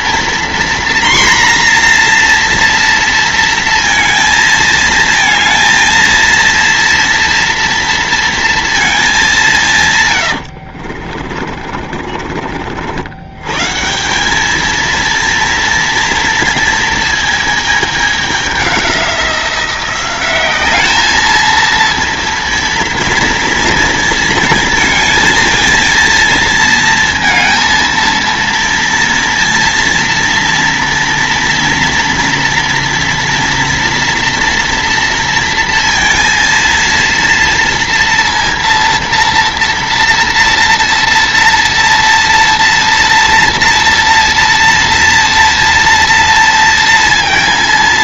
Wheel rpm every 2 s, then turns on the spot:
240, 230, 220, 230, 230, 70, 70, 220, 230, 200, 200, 230, 230, 230, 230, 230, 240, 230, 230, 230, 230, 230, 230, 230.
10-12